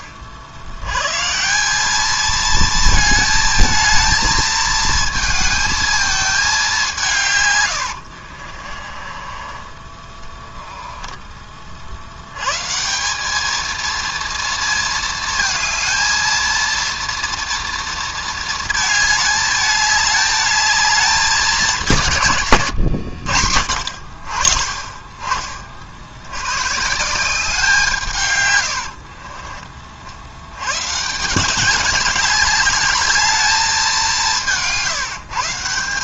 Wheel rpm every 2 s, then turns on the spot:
110, 220, 220, 170, 40, 10, 180, 230, 230, 220, 210, 90, 30, 160, 60, 140, 210, 160.
8-12 28-30